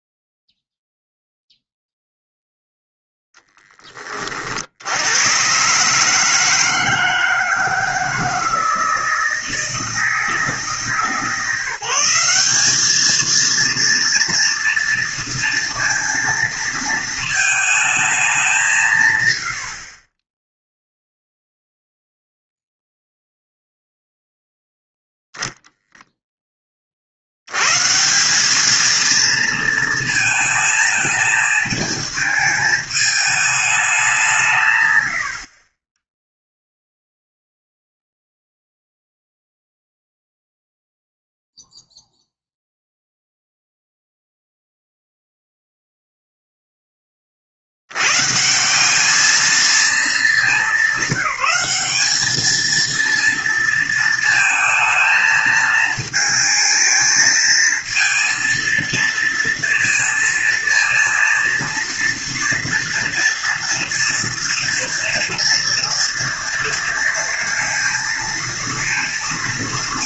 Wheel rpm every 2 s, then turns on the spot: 0, 0, 60, 160, 160, 160, 200, 240, 230, 180, 10, 0, 0, 10, 200, 220, 220, 160, 0, 0, 0, 0, 0, 0, 150, 200, 220, 230, 220, 230, 230, 230, 230, 230, 230.
none